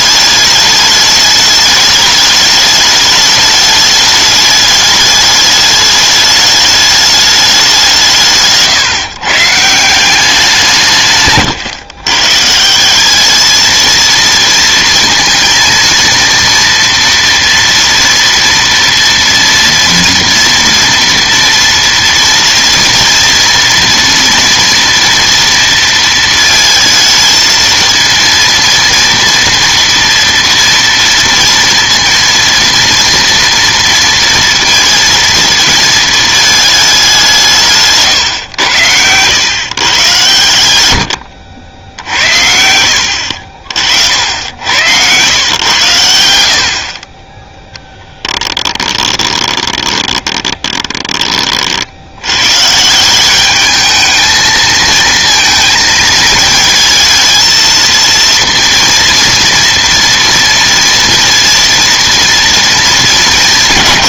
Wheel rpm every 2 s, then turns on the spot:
210, 210, 210, 210, 150, 170, 170, 230, 230, 240, 240, 230, 230, 220, 230, 230, 230, 230, 210, 110, 100, 60, 90, 70, 10, 20, 140, 220, 220, 230, 230, 230.
48-52